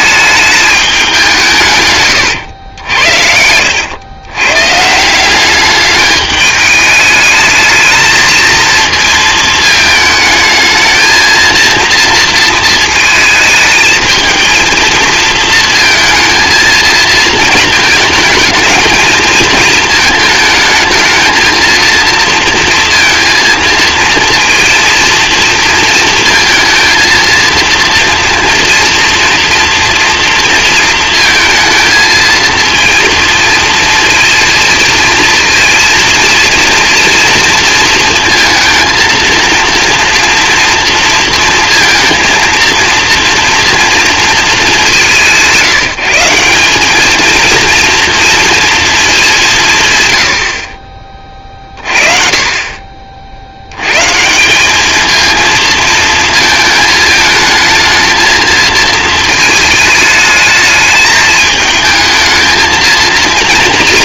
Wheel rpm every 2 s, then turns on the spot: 210, 90, 130, 210, 220, 220, 230, 230, 230, 220, 220, 230, 230, 230, 230, 230, 230, 230, 230, 230, 230, 230, 200, 180, 230, 50, 50, 190, 220, 220, 210, 220.
none